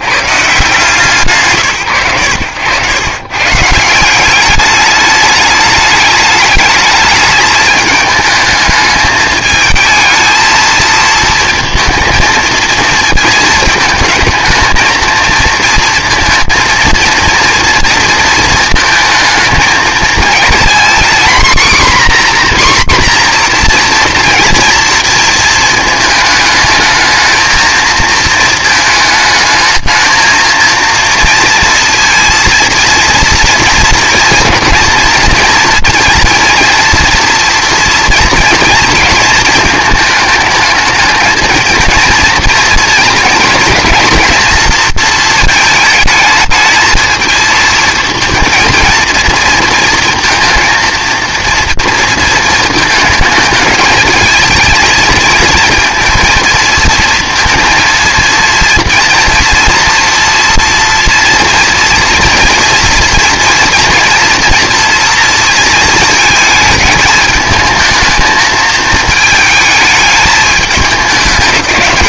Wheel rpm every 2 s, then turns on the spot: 130, 110, 210, 210, 220, 230, 230, 220, 230, 220, 240, 260, 230, 220, 220, 230, 230, 230, 230, 230, 220, 240, 230, 220, 230, 230, 230, 220, 230, 230, 240, 230, 240, 220, 220, 210.
none